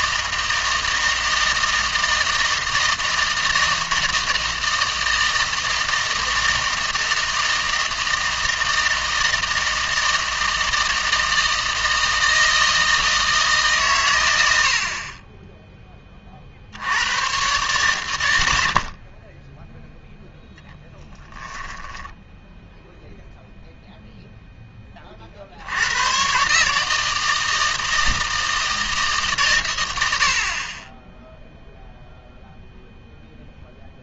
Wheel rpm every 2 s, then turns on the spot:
160, 160, 160, 160, 160, 160, 160, 70, 70, 70, 10, 10, 10, 140, 160, 40, 0.
18-22